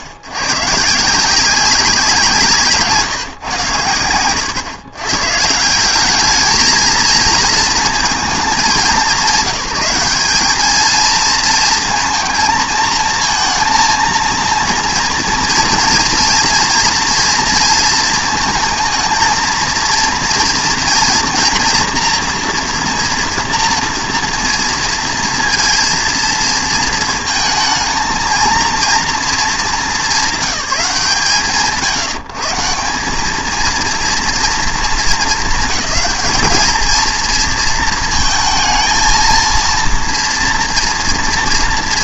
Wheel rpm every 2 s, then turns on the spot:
100, 150, 130, 220, 200, 210, 230, 230, 230, 230, 230, 230, 230, 230, 230, 180, 140, 210, 210, 230, 230.
none